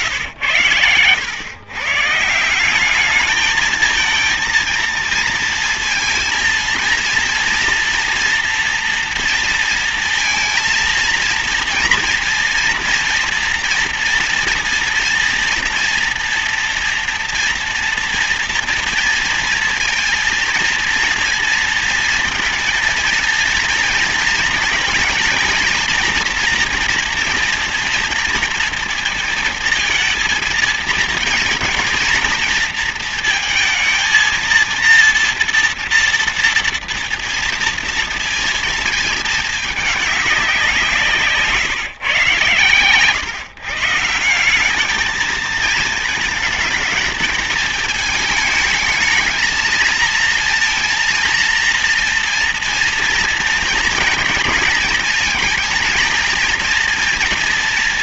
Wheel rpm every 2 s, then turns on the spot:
120, 150, 230, 230, 240, 230, 230, 230, 230, 230, 230, 240, 230, 230, 230, 230, 230, 230, 230, 230, 190, 120, 170, 220, 220, 230, 230, 230, 230.
none